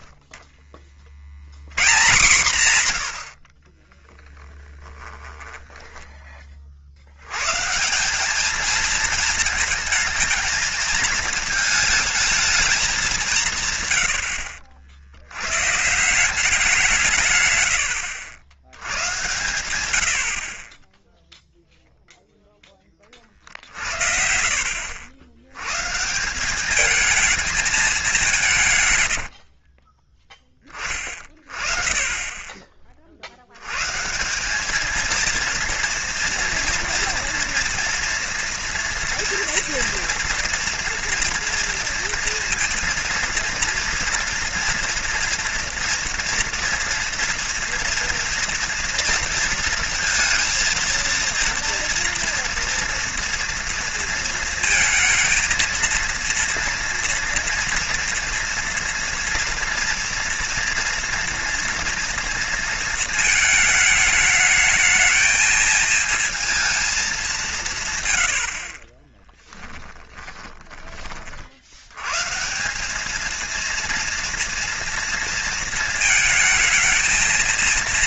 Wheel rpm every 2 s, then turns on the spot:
50, 110, 30, 50, 220, 230, 210, 70, 160, 100, 30, 20, 60, 200, 140, 30, 30, 210, 240, 230, 230, 230, 230, 230, 230, 230, 240, 230, 230, 230, 230, 220, 220, 220, 30, 20, 180, 230, 220.
4-6 28-30 68-70